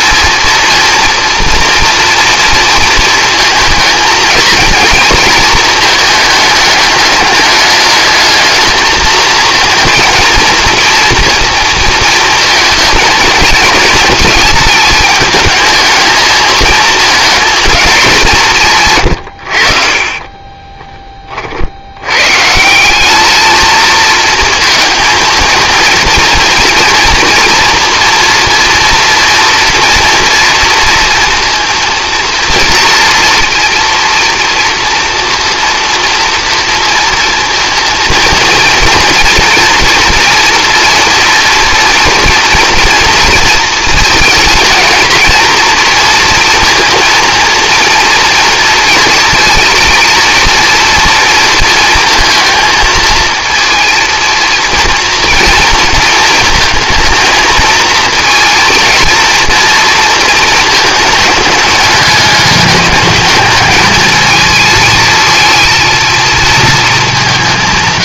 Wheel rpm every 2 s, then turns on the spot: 230, 230, 230, 210, 220, 230, 220, 220, 220, 150, 10, 170, 230, 230, 230, 230, 230, 230, 230, 230, 230, 230, 230, 230, 230, 230, 220, 230, 220, 230, 220, 210, 220, 220.
20-22